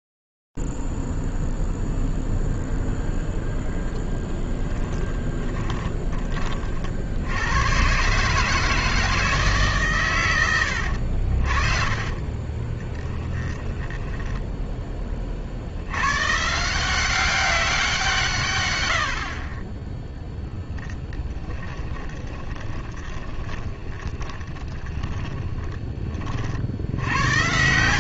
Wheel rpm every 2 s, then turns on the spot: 0, 0, 10, 20, 140, 120, 30, 10, 120, 160, 10, 20, 10, 80.
12-14 22-26